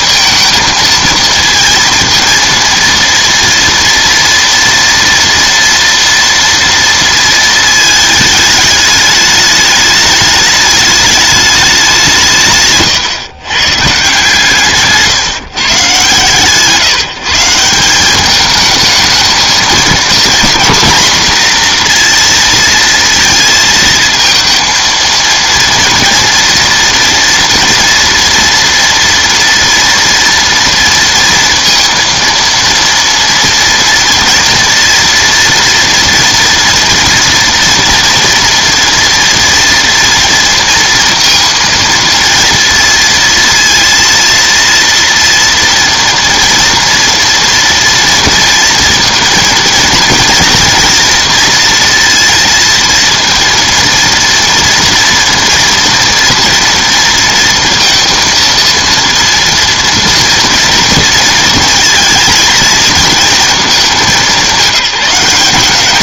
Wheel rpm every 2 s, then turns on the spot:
230, 230, 240, 230, 210, 210, 140, 140, 160, 220, 240, 230, 230, 230, 240, 230, 230, 240, 230, 230, 230, 230, 230, 230, 230, 230, 230, 230, 230, 230, 220, 220, 200.
none